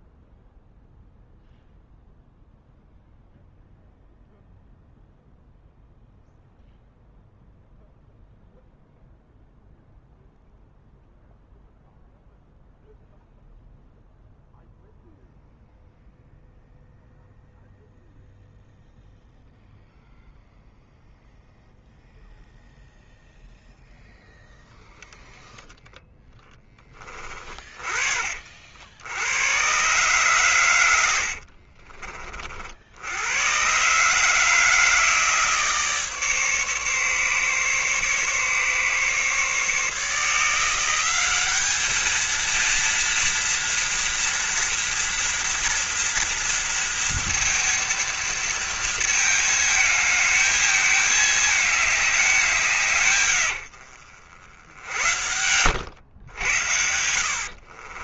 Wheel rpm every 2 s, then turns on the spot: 0, 0, 0, 0, 0, 0, 0, 0, 0, 0, 0, 0, 0, 20, 60, 110, 60, 160, 150, 150, 180, 230, 240, 230, 230, 220, 150, 70, 80.
54-56